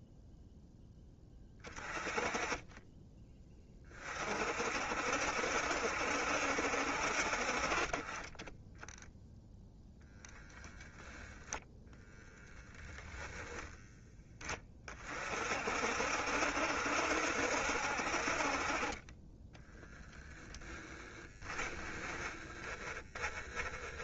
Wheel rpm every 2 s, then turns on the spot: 10, 20, 60, 60, 10, 10, 10, 30, 70, 40, 10, 10.
none